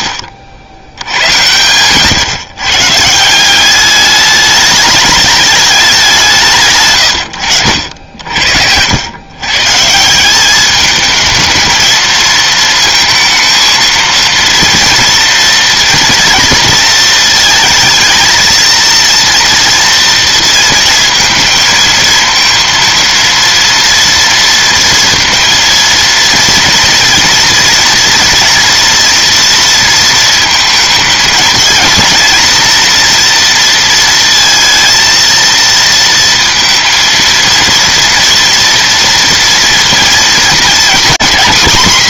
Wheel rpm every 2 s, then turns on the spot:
90, 150, 210, 130, 80, 210, 230, 230, 220, 230, 230, 230, 230, 230, 230, 220, 230, 230, 230, 230, 240.
none